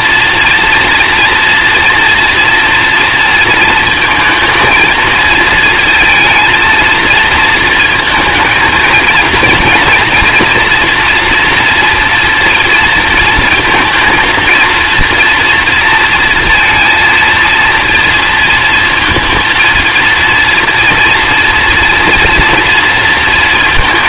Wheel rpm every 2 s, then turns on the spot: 240, 230, 220, 220, 230, 240, 230, 230, 230, 230, 230, 230.
none